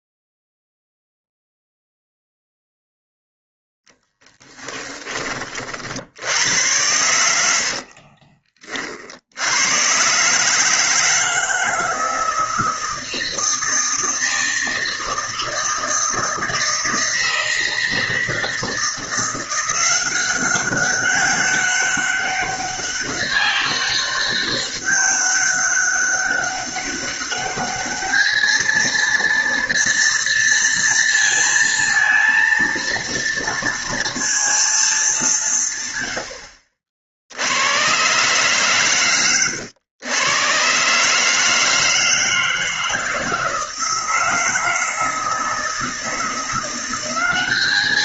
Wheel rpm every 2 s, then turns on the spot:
0, 0, 10, 90, 50, 160, 160, 160, 160, 160, 190, 200, 200, 200, 220, 230, 230, 220, 60, 130, 130, 160, 160, 180.
none